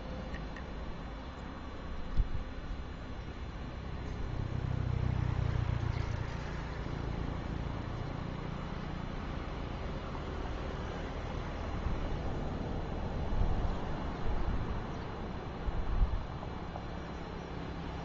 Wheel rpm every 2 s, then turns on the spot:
0, 0, 0, 0, 0, 0, 0, 0, 0.
none